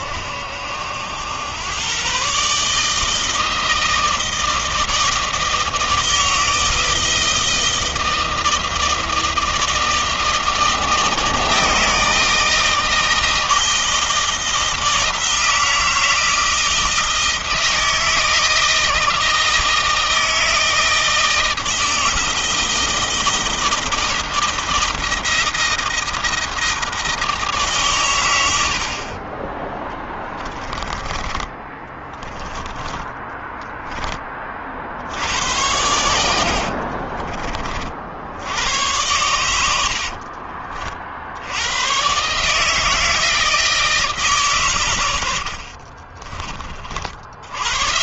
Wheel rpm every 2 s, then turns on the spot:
70, 130, 160, 160, 160, 160, 160, 160, 160, 160, 160, 160, 160, 160, 110, 20, 10, 20, 80, 80, 60, 140, 140, 30.
30-32 36-38 40-42 46-48